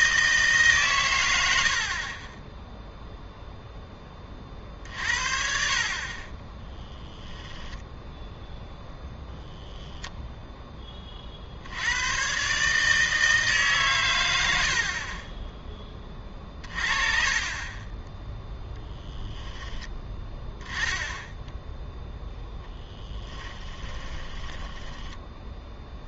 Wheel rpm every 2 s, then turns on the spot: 150, 10, 40, 20, 0, 20, 150, 80, 30, 10, 10, 10, 10.
24-26